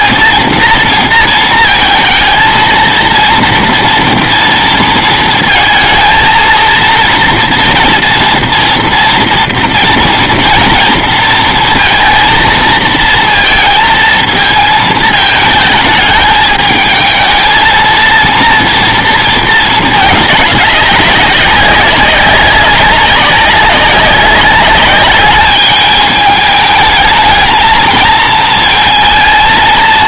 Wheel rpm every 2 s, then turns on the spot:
230, 230, 230, 230, 240, 230, 230, 220, 220, 230, 210, 200, 200, 210, 230.
none